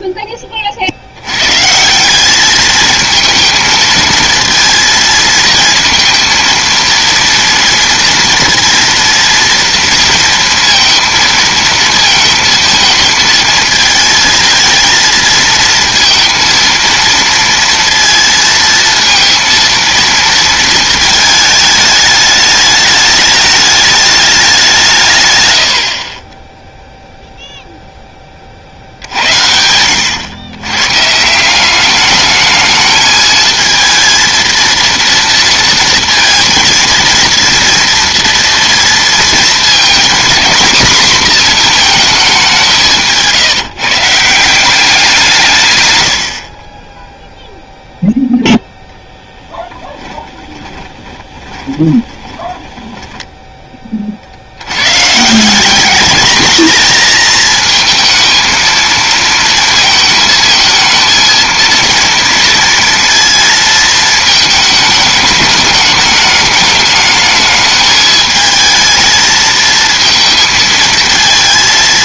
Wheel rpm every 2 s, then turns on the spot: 30, 210, 230, 230, 230, 230, 220, 230, 230, 230, 230, 210, 180, 10, 60, 110, 210, 230, 230, 230, 240, 190, 180, 40, 0, 20, 20, 90, 220, 220, 220, 230, 220, 210, 220, 230.
50-54